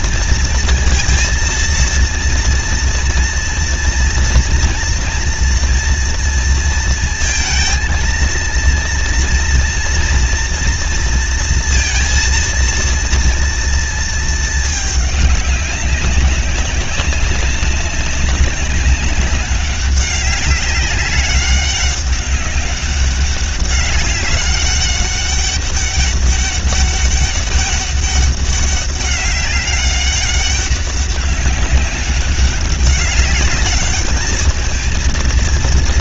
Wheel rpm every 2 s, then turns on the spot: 230, 230, 230, 230, 230, 230, 230, 220, 200, 200, 200, 200, 200, 200, 200, 200, 200, 210.
none